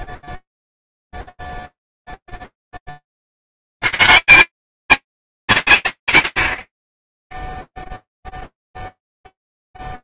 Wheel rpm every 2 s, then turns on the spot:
0, 0, 150, 80, 0.
none